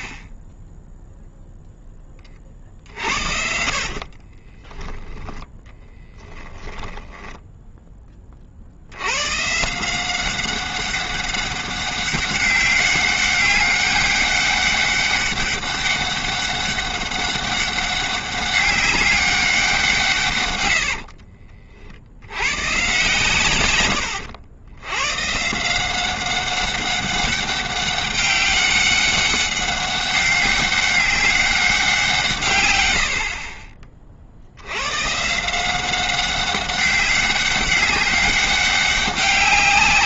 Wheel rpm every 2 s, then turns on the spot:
10, 40, 20, 10, 50, 190, 190, 200, 200, 200, 100, 110, 100, 200, 200, 190, 120, 90, 190, 200.
4-8